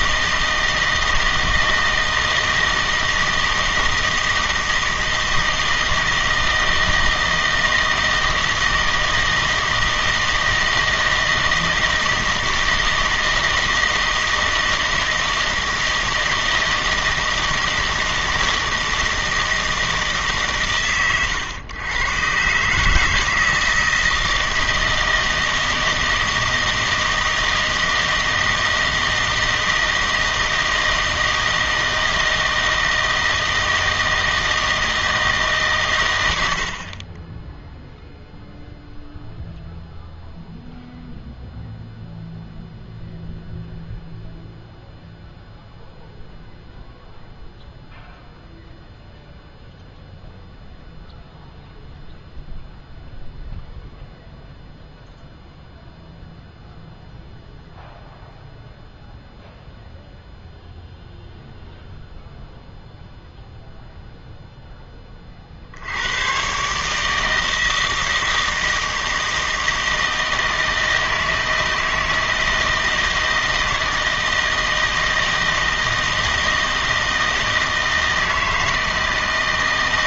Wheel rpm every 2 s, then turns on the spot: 160, 160, 160, 160, 160, 160, 160, 160, 160, 160, 130, 140, 160, 160, 160, 160, 160, 160, 80, 0, 0, 0, 0, 0, 0, 0, 0, 0, 0, 0, 0, 0, 0, 130, 160, 160, 160, 160, 160, 160.
none